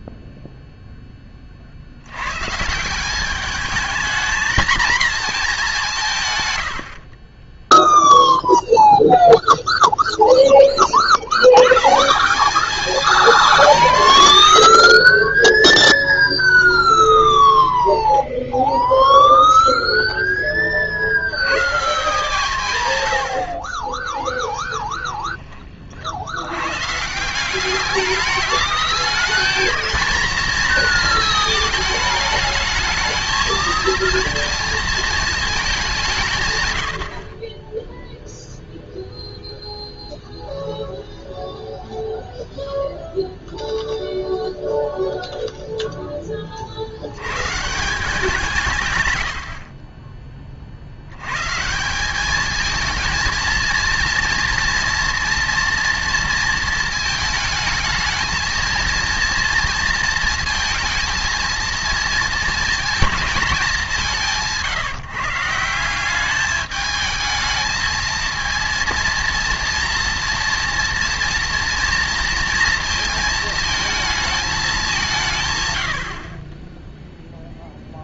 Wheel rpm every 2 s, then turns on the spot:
0, 170, 230, 80, 0, 30, 210, 70, 10, 0, 40, 140, 10, 130, 210, 230, 220, 230, 100, 0, 0, 0, 0, 60, 140, 70, 220, 230, 220, 230, 220, 230, 160, 210, 230, 240, 230, 200, 20.
16-18 24-26